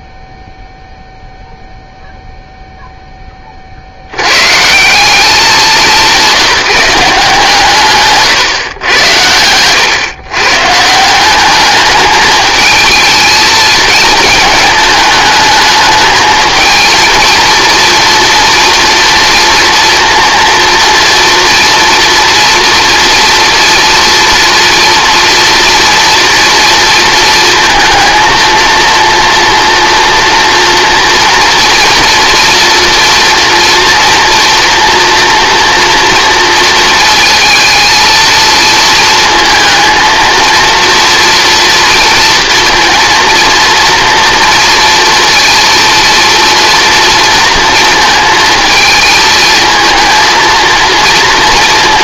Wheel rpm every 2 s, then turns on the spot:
0, 0, 140, 190, 120, 150, 220, 210, 220, 240, 230, 230, 230, 230, 230, 230, 230, 230, 230, 230, 230, 230, 230, 230, 220, 230.
none